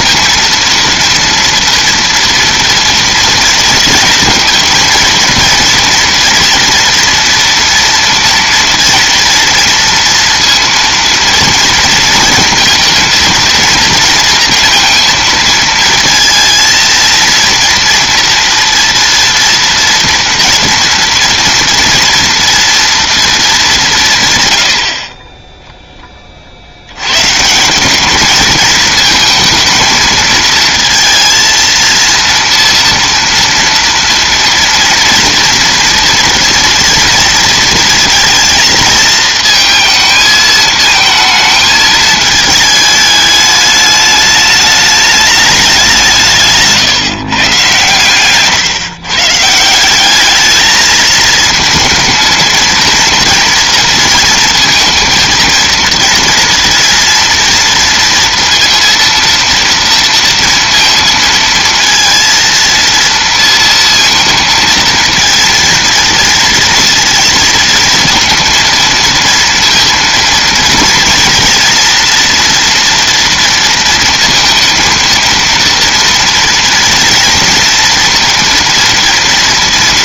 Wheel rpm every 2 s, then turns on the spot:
230, 230, 230, 240, 230, 230, 230, 230, 220, 230, 230, 230, 120, 40, 220, 220, 230, 230, 230, 230, 220, 210, 210, 160, 140, 210, 230, 230, 230, 230, 230, 230, 230, 230, 230, 230, 230, 230, 230, 230.
none